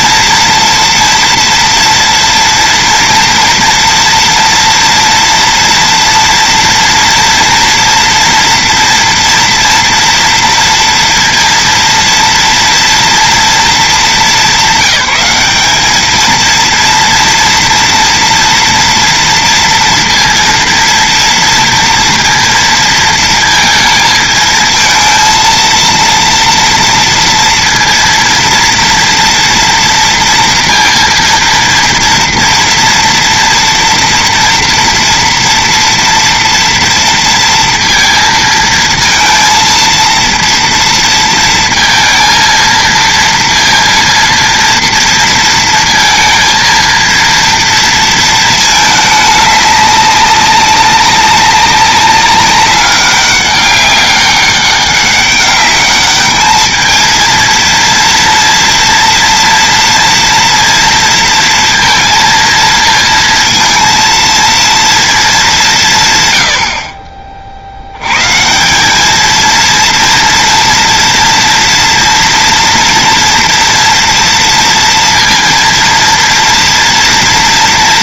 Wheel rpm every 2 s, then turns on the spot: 230, 230, 230, 230, 230, 240, 230, 200, 220, 230, 230, 230, 220, 230, 230, 230, 230, 230, 230, 230, 230, 230, 230, 230, 230, 200, 190, 200, 210, 230, 230, 230, 230, 130, 120, 230, 230, 230, 230.
none